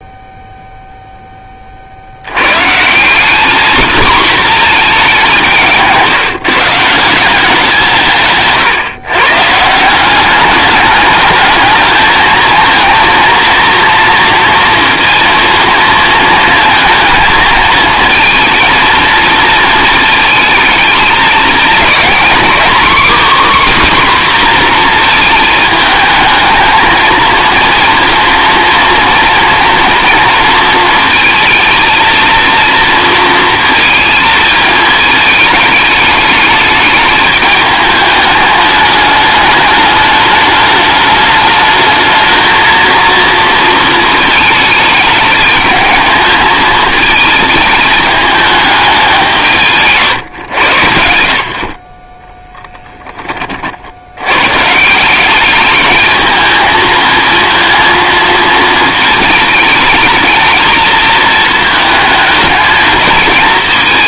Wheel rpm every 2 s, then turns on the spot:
0, 160, 230, 160, 140, 210, 230, 230, 230, 230, 220, 260, 240, 220, 230, 230, 230, 220, 210, 210, 210, 230, 220, 220, 200, 100, 10, 150, 230, 220, 230, 220.
none